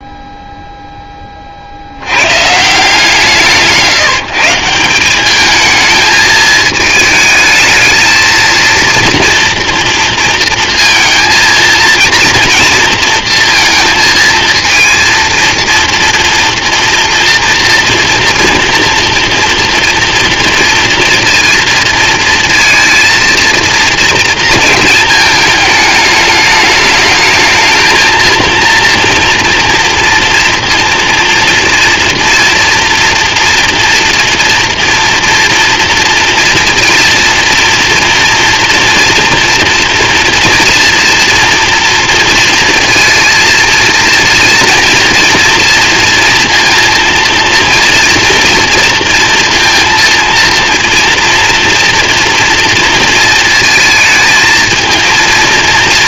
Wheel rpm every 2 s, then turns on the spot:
0, 150, 180, 220, 230, 230, 230, 230, 240, 240, 230, 230, 220, 210, 230, 230, 230, 230, 230, 240, 230, 230, 230, 230, 230, 230, 230, 220.
none